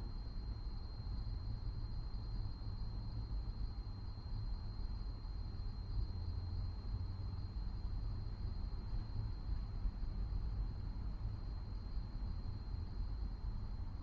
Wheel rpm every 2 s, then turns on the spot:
0, 0, 0, 0, 0, 0, 0.
none